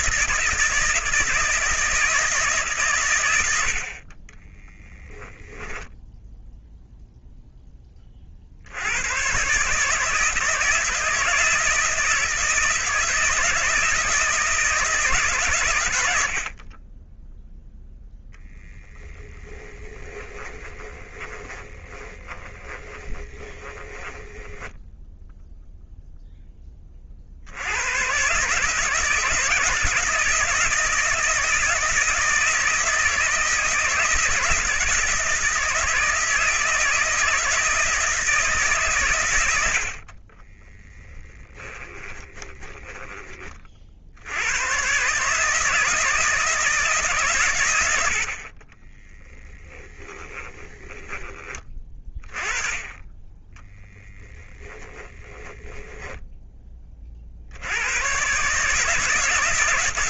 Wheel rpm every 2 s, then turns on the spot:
160, 120, 10, 0, 100, 160, 160, 160, 20, 10, 20, 20, 0, 40, 160, 170, 160, 160, 160, 130, 10, 20, 130, 160, 20, 10, 20, 10, 40, 150.
4-6 18-24 40-44 48-52 54-56